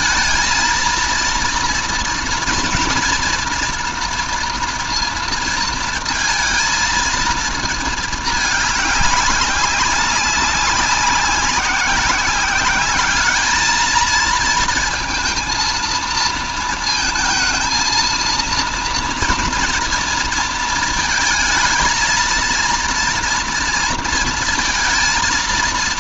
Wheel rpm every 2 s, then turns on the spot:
230, 240, 230, 230, 200, 190, 200, 220, 230, 230, 230, 230, 220.
none